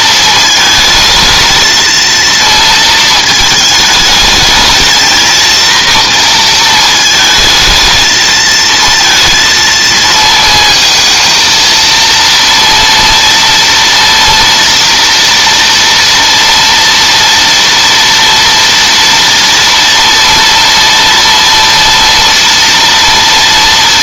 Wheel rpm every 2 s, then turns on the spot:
230, 230, 220, 230, 220, 220, 230, 230, 230, 230, 230, 230.
none